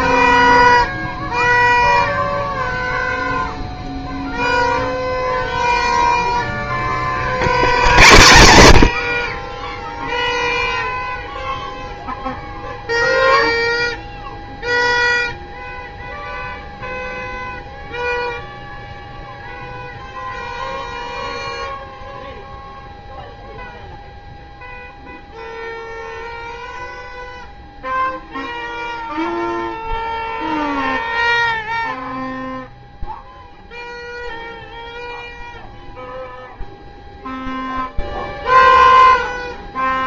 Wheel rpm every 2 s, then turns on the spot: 0, 0, 0, 0, 80, 0, 0, 0, 0, 0, 0, 0, 0, 0, 0, 0, 0, 0, 0, 0.
none